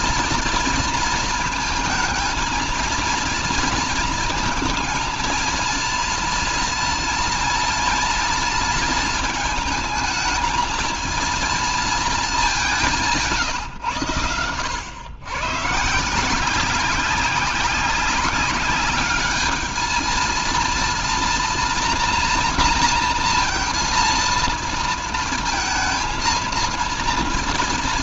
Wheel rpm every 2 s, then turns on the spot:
230, 230, 230, 230, 230, 230, 200, 90, 180, 200, 230, 240, 230, 230.
none